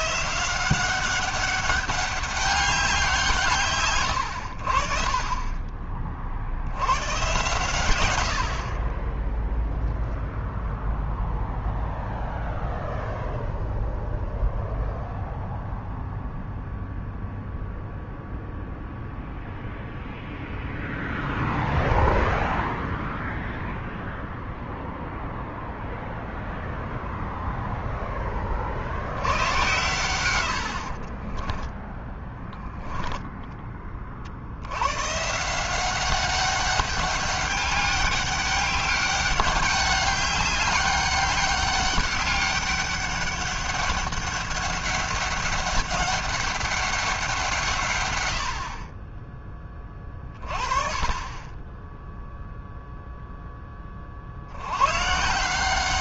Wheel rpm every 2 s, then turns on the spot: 190, 170, 40, 110, 20, 0, 0, 0, 0, 0, 0, 0, 0, 0, 80, 40, 0, 130, 200, 190, 200, 200, 200, 180, 30, 20, 0, 140.
30-32